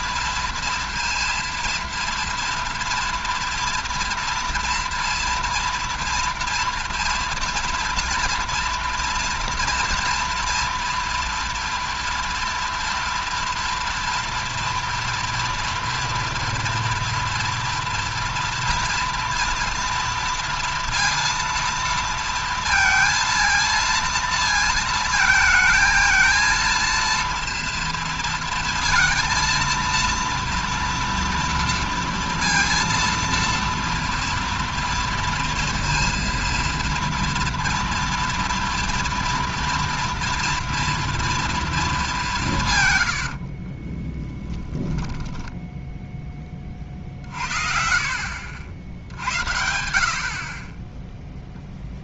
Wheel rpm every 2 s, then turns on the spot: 230, 230, 230, 230, 230, 230, 230, 230, 230, 230, 230, 230, 230, 230, 230, 230, 230, 230, 230, 230, 230, 160, 20, 50, 80, 30.
44-46